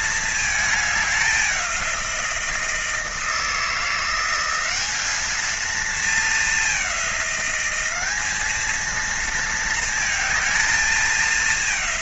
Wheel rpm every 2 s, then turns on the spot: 210, 170, 200, 200, 220, 220.
none